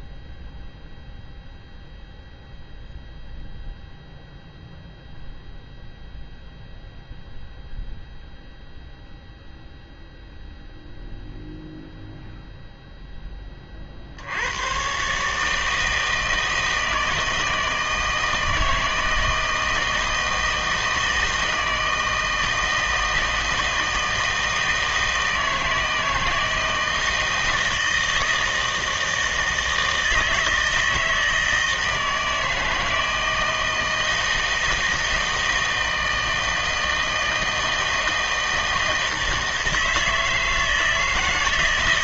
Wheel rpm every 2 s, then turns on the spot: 0, 0, 0, 0, 0, 0, 0, 100, 160, 160, 160, 160, 160, 160, 160, 160, 160, 160, 160, 160, 160.
none